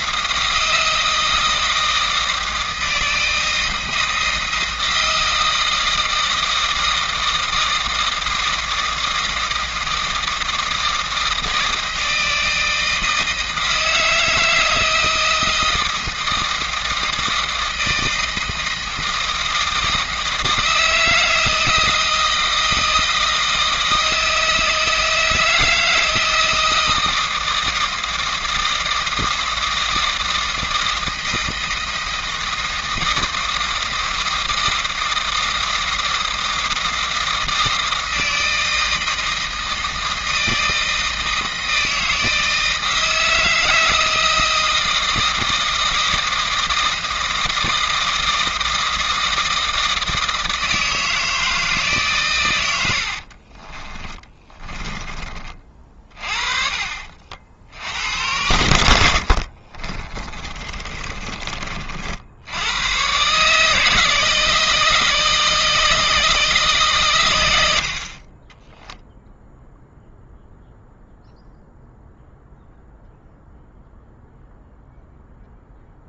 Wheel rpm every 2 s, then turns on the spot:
160, 160, 160, 160, 160, 160, 160, 160, 160, 160, 160, 160, 160, 160, 160, 160, 160, 160, 160, 160, 160, 160, 160, 160, 160, 160, 110, 20, 40, 90, 30, 80, 160, 160, 30, 0, 0, 0.
54-56 60-62